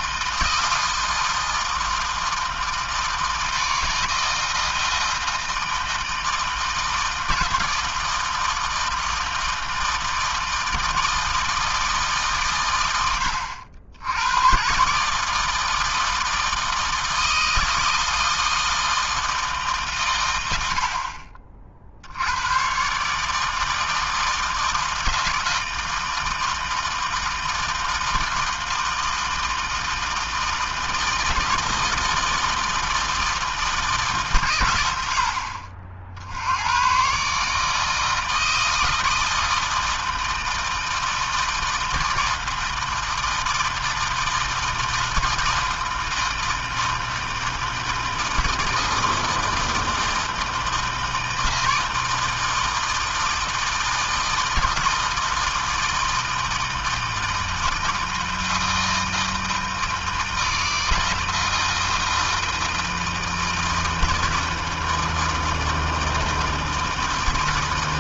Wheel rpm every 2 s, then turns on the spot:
160, 160, 160, 160, 160, 160, 100, 150, 160, 160, 40, 150, 160, 160, 160, 160, 160, 80, 130, 160, 160, 160, 160, 160, 160, 160, 160, 160, 160, 160, 160, 160, 160, 160.
none